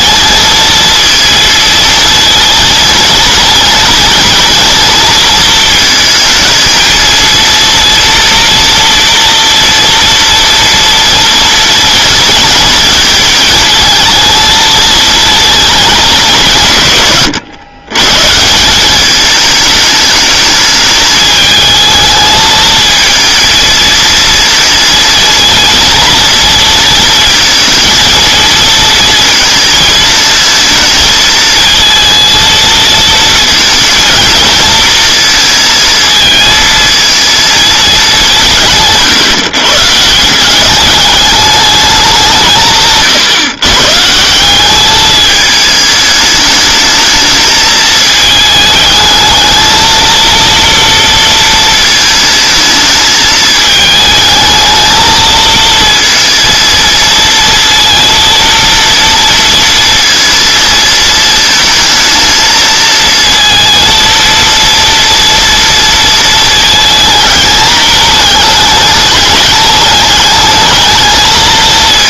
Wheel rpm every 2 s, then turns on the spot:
230, 230, 230, 220, 240, 230, 230, 220, 120, 190, 210, 220, 230, 230, 230, 230, 230, 230, 220, 150, 190, 150, 200, 210, 220, 230, 220, 220, 230, 230, 220, 220, 230, 220, 210, 220.
none